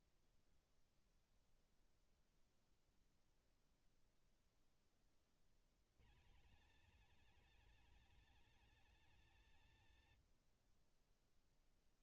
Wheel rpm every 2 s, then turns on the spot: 0, 0, 0, 150, 240, 70.
none